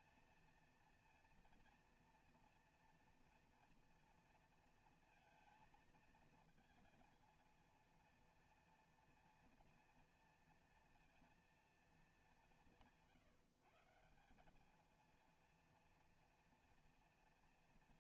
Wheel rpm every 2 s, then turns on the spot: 230, 230, 230, 230, 230, 230, 190, 190, 230.
none